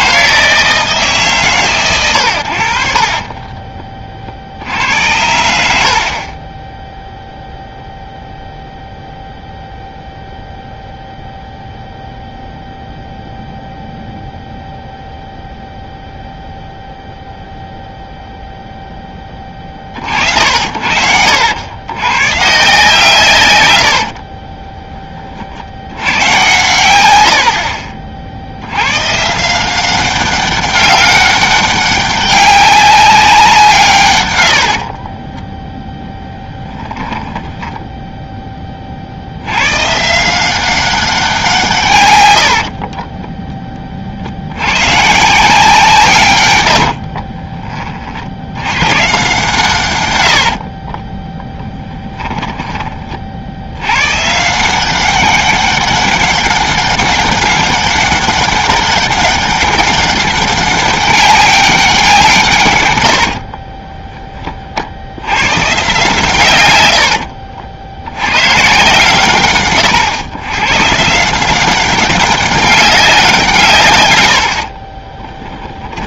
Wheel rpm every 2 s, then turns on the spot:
160, 60, 70, 0, 0, 0, 0, 0, 0, 0, 60, 140, 10, 110, 100, 200, 200, 70, 10, 20, 190, 50, 110, 80, 110, 50, 20, 180, 200, 200, 200, 120, 70, 100, 130, 130, 200, 40.
34-38 42-44 46-48 50-52 74-76